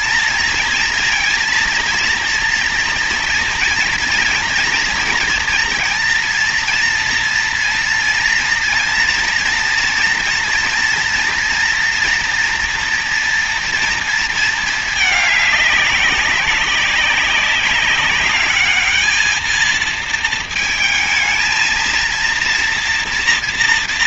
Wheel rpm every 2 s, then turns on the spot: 240, 230, 230, 230, 230, 240, 240, 220, 190, 210, 220, 240.
none